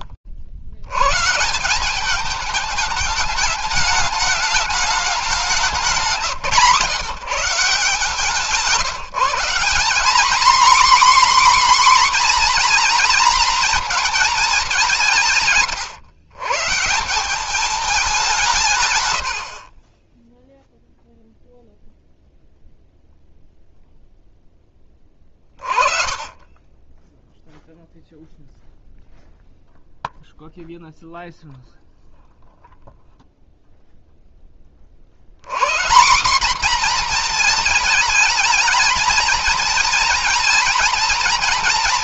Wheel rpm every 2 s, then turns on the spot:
210, 210, 160, 160, 240, 250, 220, 130, 200, 20, 0, 0, 20, 0, 0, 0, 0, 150, 230, 230, 240.
18-20